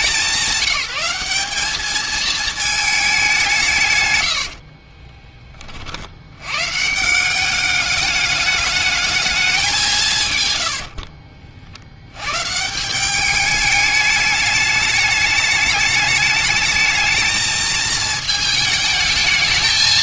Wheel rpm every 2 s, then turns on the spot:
200, 220, 60, 110, 210, 100, 140, 210, 220, 220.
4-6 10-12